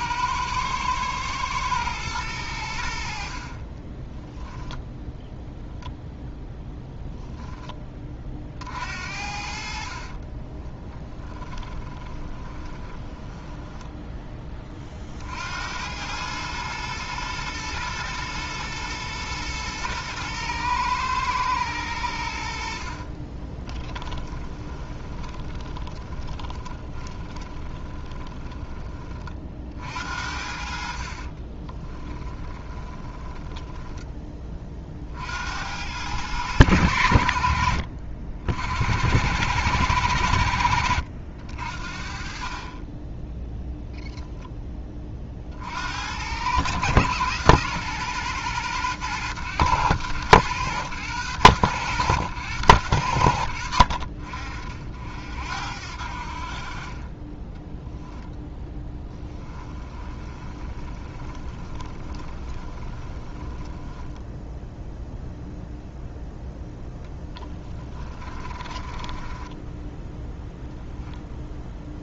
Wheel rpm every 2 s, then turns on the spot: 110, 70, 10, 0, 50, 10, 20, 40, 110, 120, 120, 50, 20, 20, 20, 50, 20, 40, 90, 70, 70, 30, 20, 110, 110, 110, 90, 60, 30, 0, 20, 20, 0, 10, 30, 0.
10-14 22-28 32-34 60-64 66-70